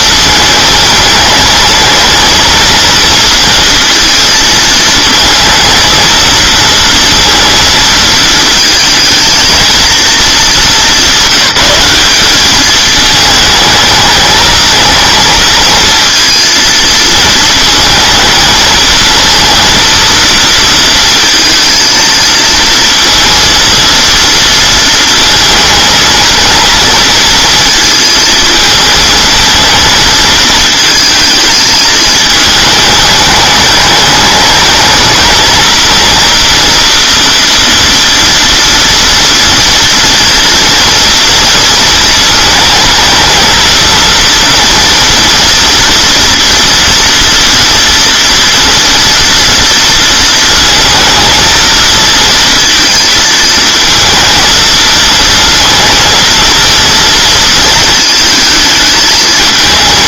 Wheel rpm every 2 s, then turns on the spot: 220, 230, 230, 230, 220, 210, 210, 220, 230, 220, 230, 230, 230, 230, 220, 220, 210, 220, 230, 230, 230, 220, 230, 230, 230, 230, 230, 230, 230, 220.
none